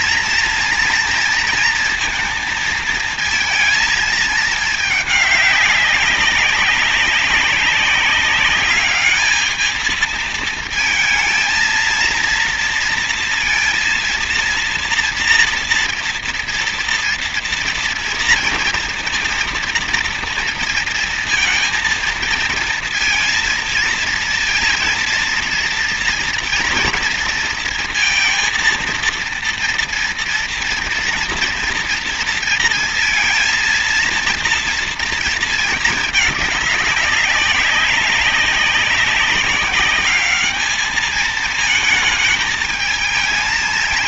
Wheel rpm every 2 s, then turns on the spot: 230, 230, 210, 190, 210, 220, 230, 230, 230, 230, 230, 230, 230, 230, 230, 230, 230, 230, 210, 200, 210, 220.
none